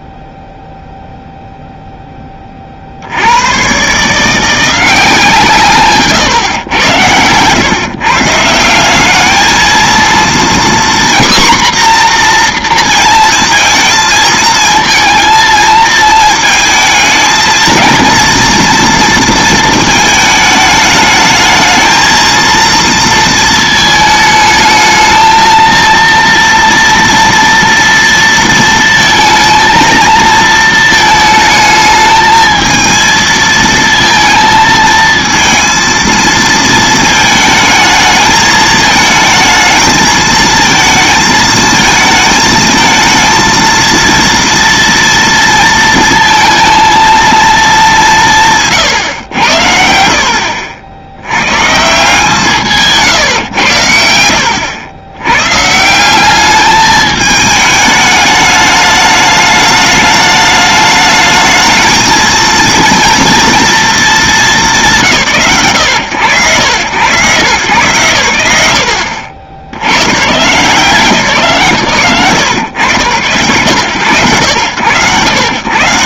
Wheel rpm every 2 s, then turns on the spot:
0, 80, 170, 110, 200, 250, 230, 220, 220, 230, 220, 230, 230, 230, 230, 220, 220, 230, 220, 220, 220, 220, 230, 230, 120, 80, 150, 100, 210, 210, 210, 230, 190, 110, 90, 160, 100, 90.
6-8 48-50